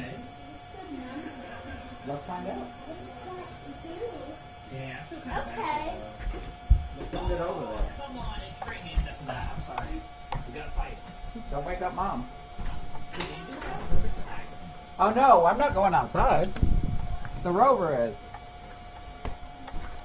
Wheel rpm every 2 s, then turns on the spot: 0, 0, 0, 0, 0, 0, 0, 0, 0, 0.
none